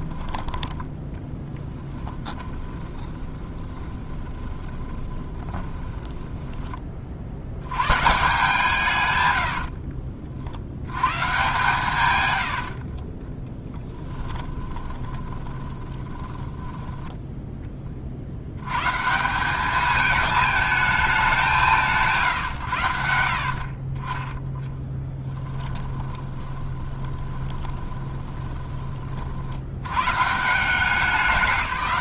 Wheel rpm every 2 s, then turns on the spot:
10, 20, 20, 30, 150, 90, 50, 30, 10, 120, 220, 110, 10, 20, 30, 180.
2-6 12-16 24-30